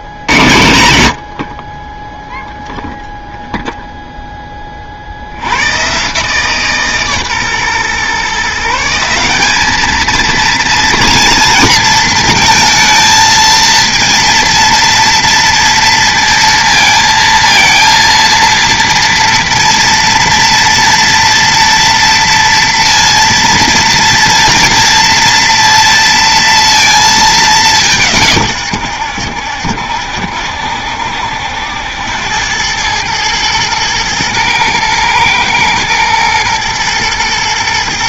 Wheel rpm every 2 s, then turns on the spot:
100, 0, 50, 150, 170, 230, 230, 230, 230, 230, 240, 230, 240, 230, 100, 70, 100, 120, 110.
none